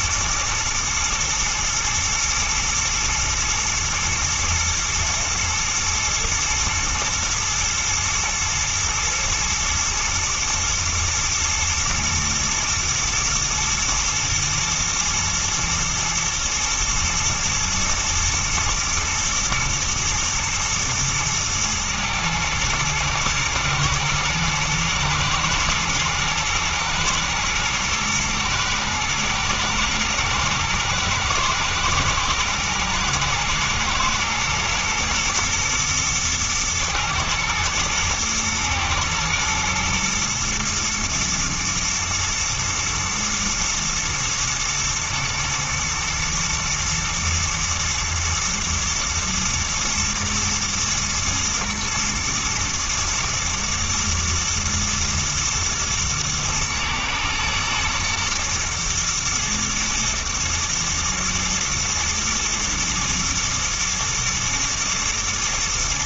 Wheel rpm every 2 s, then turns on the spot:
110, 110, 110, 120, 120, 110, 110, 120, 120, 110, 110, 110, 120, 110, 110, 110, 110, 120, 110, 120, 120, 110, 110, 120, 110, 120, 120, 110, 110, 110, 110, 110, 110.
none